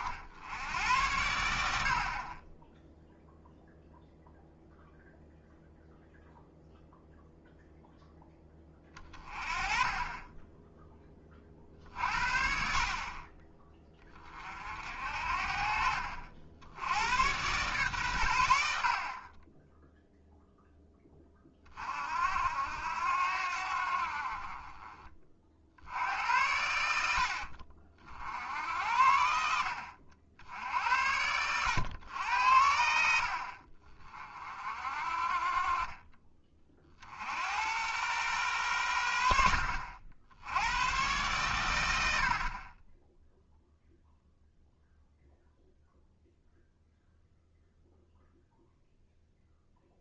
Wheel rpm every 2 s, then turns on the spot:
90, 10, 0, 0, 20, 20, 50, 50, 80, 80, 10, 70, 30, 80, 60, 70, 70, 50, 30, 100, 100, 30, 0, 0, 0.
42-44